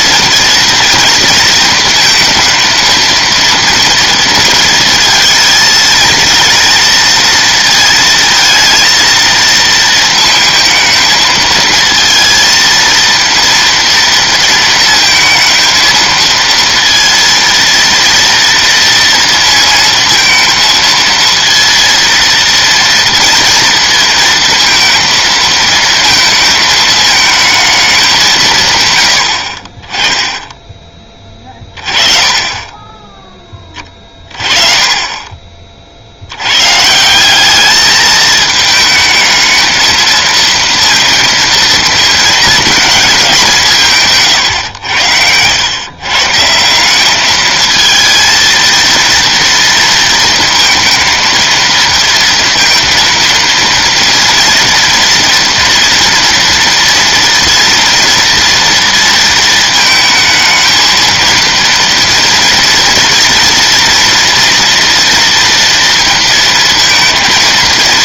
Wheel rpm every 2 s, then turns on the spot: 240, 230, 230, 230, 230, 220, 230, 230, 230, 230, 230, 230, 230, 220, 130, 10, 20, 30, 140, 220, 230, 230, 110, 170, 230, 230, 230, 230, 230, 230, 230, 230, 230, 230.
none